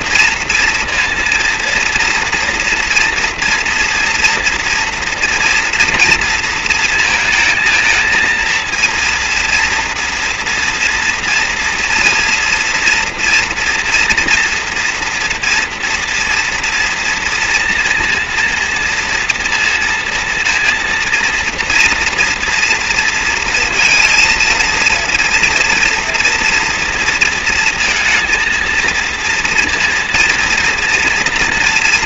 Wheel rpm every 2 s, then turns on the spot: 230, 230, 230, 230, 230, 230, 230, 230, 230, 230, 230, 230, 230, 230, 230, 240.
none